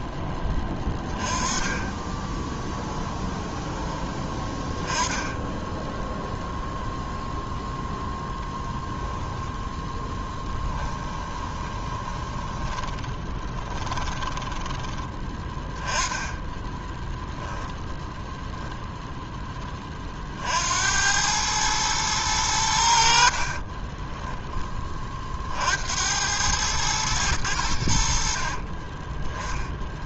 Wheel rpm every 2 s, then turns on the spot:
20, 10, 10, 0, 10, 10, 20, 10, 10, 0, 80, 90, 20, 110, 40.
2-4 10-16 28-30